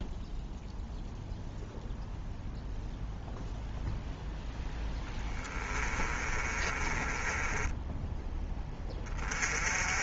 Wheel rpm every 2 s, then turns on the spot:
0, 0, 10, 30, 10.
6-8